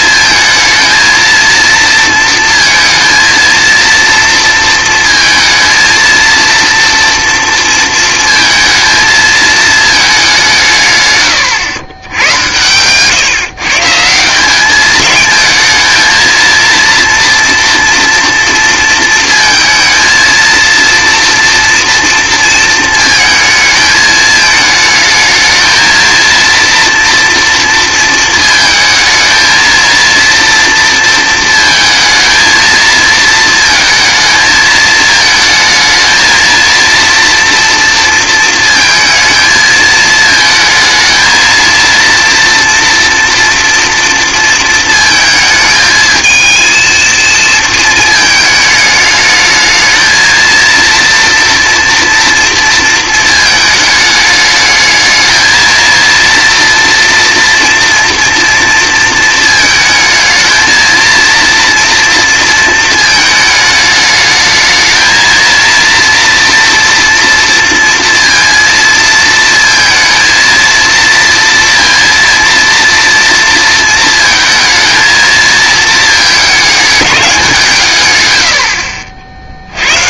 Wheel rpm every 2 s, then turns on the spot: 220, 230, 230, 230, 220, 160, 120, 200, 230, 230, 230, 230, 220, 230, 220, 230, 220, 220, 230, 230, 230, 240, 230, 220, 210, 230, 230, 210, 230, 230, 220, 230, 220, 230, 230, 230, 230, 220, 220, 80.
none